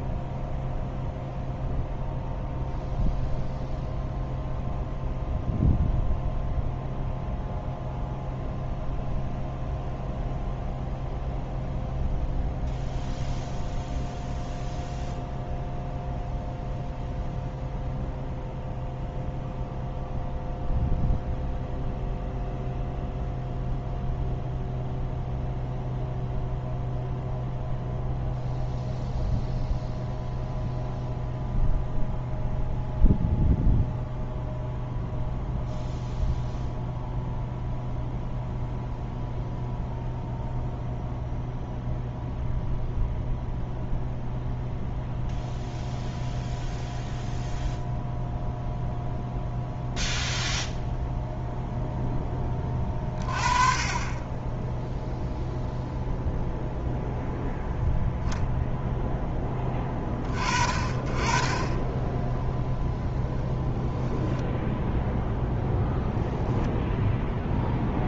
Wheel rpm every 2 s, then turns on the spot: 0, 0, 0, 0, 0, 0, 0, 0, 0, 0, 0, 0, 0, 0, 0, 0, 0, 0, 0, 0, 0, 0, 0, 0, 0, 0, 20, 10, 0, 0, 30, 0, 10, 10.
66-68